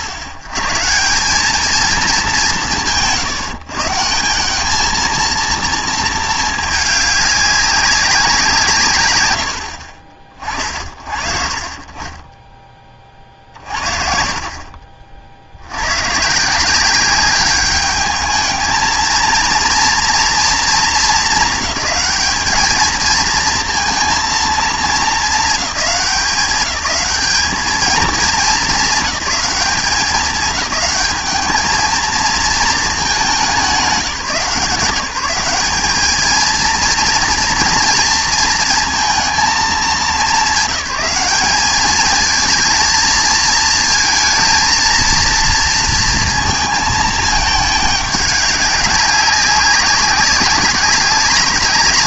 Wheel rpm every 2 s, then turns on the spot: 90, 120, 210, 210, 180, 50, 20, 20, 180, 220, 230, 210, 220, 200, 220, 210, 230, 170, 230, 230, 190, 220, 220, 230, 200, 190.
none